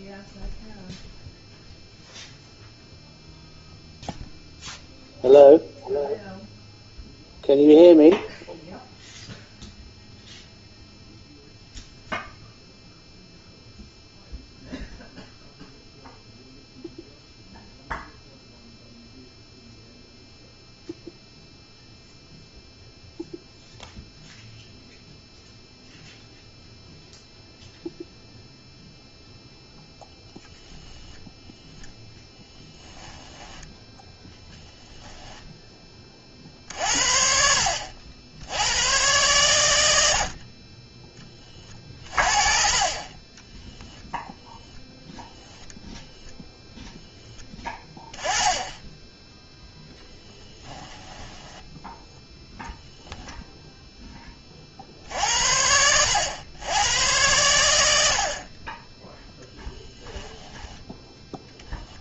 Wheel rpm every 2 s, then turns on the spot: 0, 0, 0, 0, 0, 0, 0, 0, 0, 0, 0, 0, 0, 0, 0, 0, 10, 0, 50, 100, 30, 40, 0, 0, 10, 10, 0, 40, 100, 20, 10.
42-44 50-52